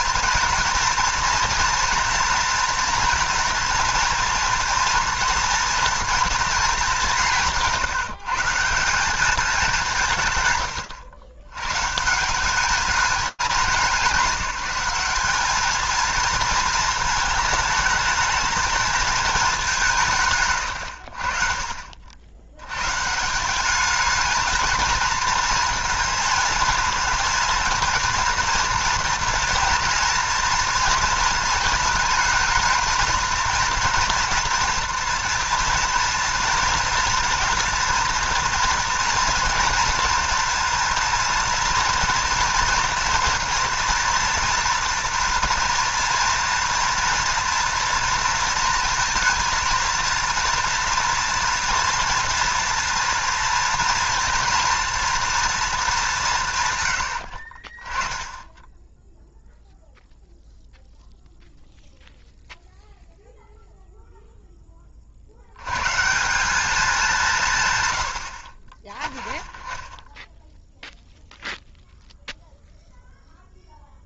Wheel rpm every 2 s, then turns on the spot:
230, 230, 230, 210, 180, 110, 200, 200, 220, 220, 100, 120, 220, 220, 230, 230, 220, 230, 240, 230, 230, 230, 240, 230, 230, 230, 230, 230, 130, 10, 0, 0, 20, 210, 40, 0, 0.
10-12